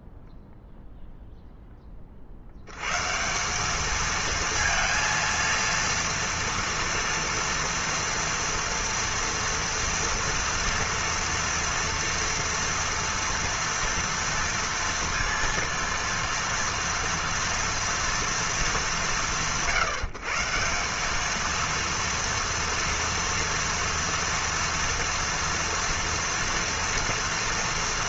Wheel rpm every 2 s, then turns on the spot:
0, 90, 230, 240, 230, 230, 240, 230, 230, 180, 160, 230, 230, 230.
none